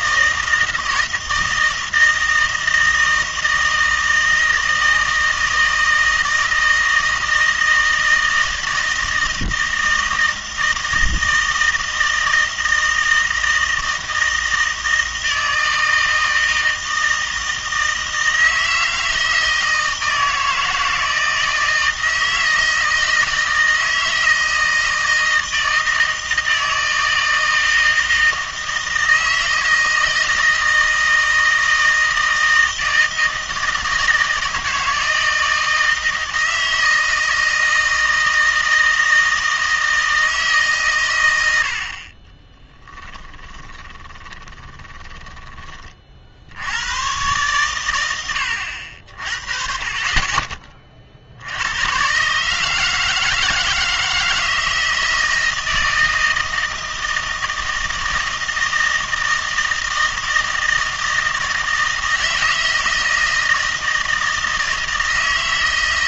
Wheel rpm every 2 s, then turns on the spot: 160, 160, 160, 160, 160, 160, 160, 160, 160, 160, 160, 160, 160, 160, 160, 160, 160, 160, 160, 160, 140, 10, 20, 90, 80, 30, 150, 160, 160, 160, 160, 160, 160.
42-46